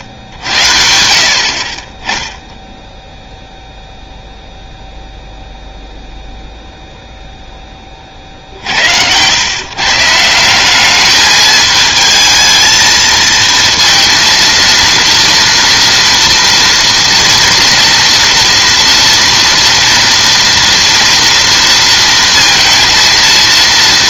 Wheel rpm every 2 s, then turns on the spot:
70, 0, 0, 0, 70, 200, 220, 230, 230, 230, 230, 230.
0-2